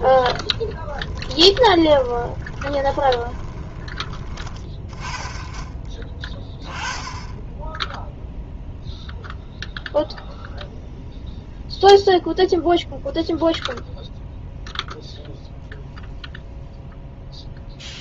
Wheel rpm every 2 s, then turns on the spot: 30, 20, 20, 10, 0, 0, 0, 0, 0.
0-4